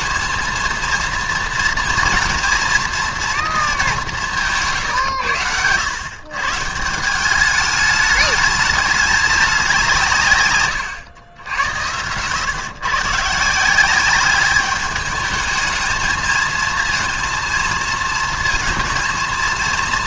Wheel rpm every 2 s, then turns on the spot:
230, 230, 210, 120, 210, 160, 100, 190, 220, 220.
none